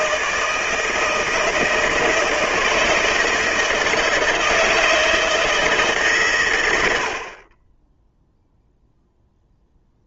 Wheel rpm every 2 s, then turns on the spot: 160, 160, 160, 100, 0.
none